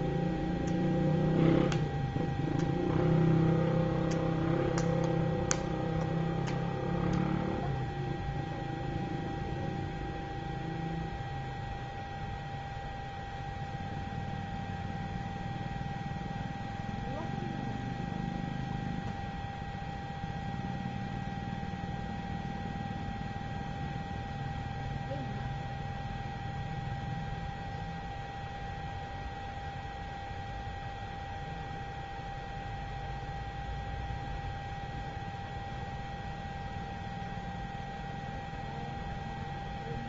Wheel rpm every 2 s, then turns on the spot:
0, 0, 0, 0, 0, 0, 0, 0, 0, 0, 0, 0, 0, 0, 0, 0, 0, 0, 0, 0.
none